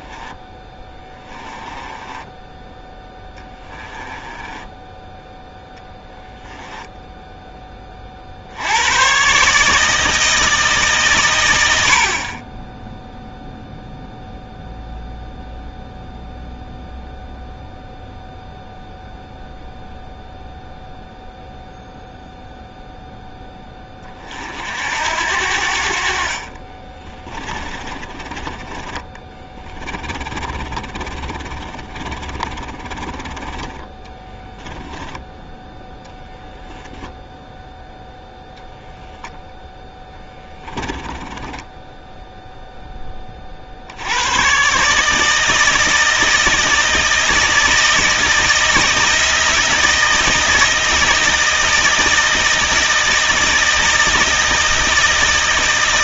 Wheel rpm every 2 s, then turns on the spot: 10, 10, 10, 0, 100, 140, 10, 0, 0, 0, 0, 0, 70, 30, 20, 30, 20, 10, 0, 0, 20, 10, 140, 160, 160, 160, 160, 160.
0-2 4-6 26-32 34-36 40-42